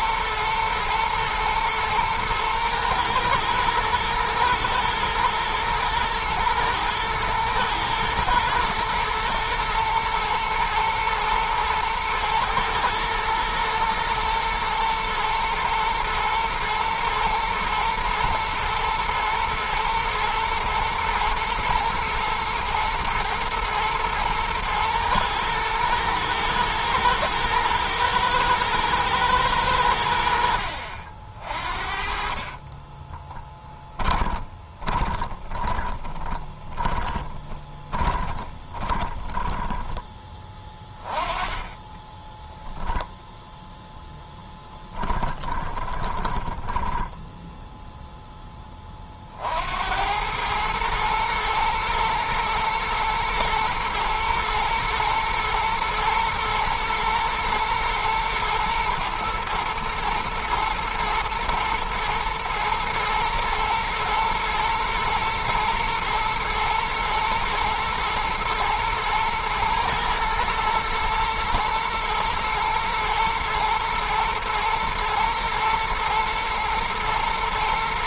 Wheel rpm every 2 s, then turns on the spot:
110, 110, 120, 110, 120, 120, 110, 120, 120, 110, 110, 120, 110, 110, 120, 60, 20, 20, 20, 20, 20, 0, 10, 10, 30, 110, 120, 110, 110, 110, 120, 110, 120, 110, 110, 120, 120, 110, 120.
32-40 44-48